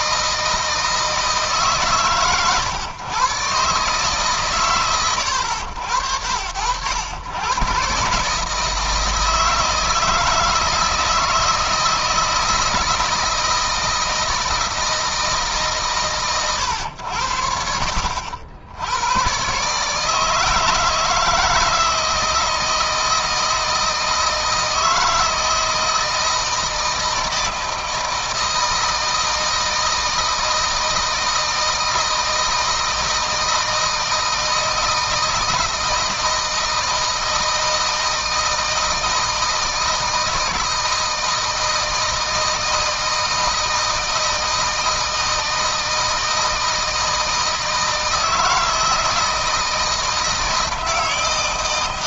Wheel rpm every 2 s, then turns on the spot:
160, 130, 130, 90, 150, 160, 160, 160, 110, 70, 160, 160, 160, 160, 160, 160, 160, 160, 160, 160, 160, 160, 160, 160, 160, 160.
none